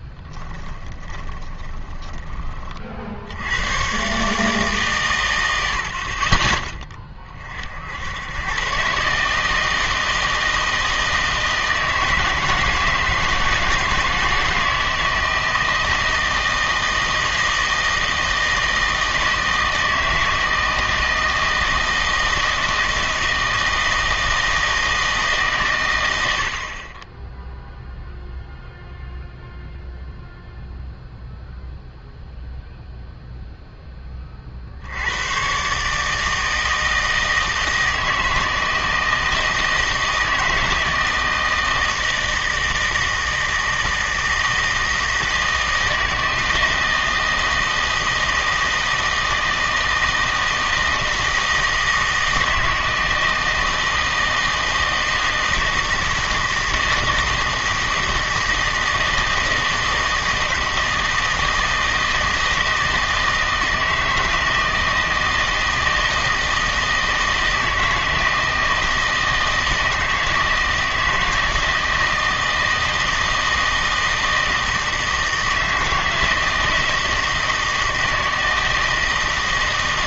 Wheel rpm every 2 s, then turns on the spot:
20, 40, 150, 30, 120, 160, 160, 160, 160, 160, 160, 160, 160, 40, 0, 0, 0, 60, 160, 160, 160, 160, 160, 160, 160, 160, 160, 160, 160, 160, 160, 160, 160, 160, 160, 160, 160, 160, 160, 160.
0-2